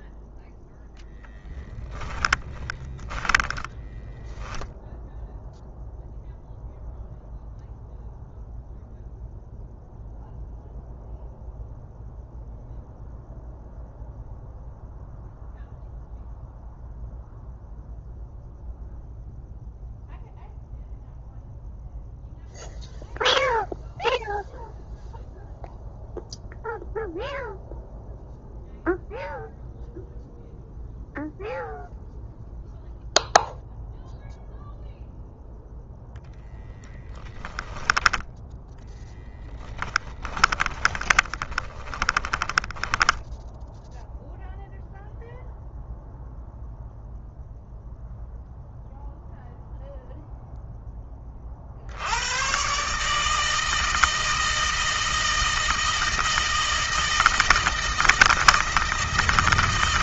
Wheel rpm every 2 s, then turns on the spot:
10, 20, 0, 0, 0, 0, 0, 0, 0, 0, 0, 0, 0, 0, 0, 0, 0, 0, 10, 10, 10, 10, 0, 0, 0, 10, 140, 160, 160, 160.
2-4 40-42